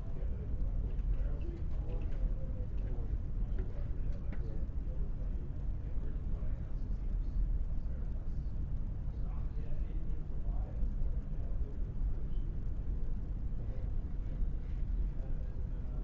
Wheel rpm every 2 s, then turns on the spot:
0, 0, 0, 0, 0, 0, 0, 0.
none